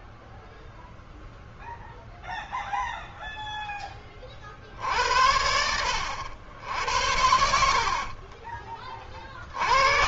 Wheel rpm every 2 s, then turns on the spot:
0, 0, 60, 80, 40.
6-8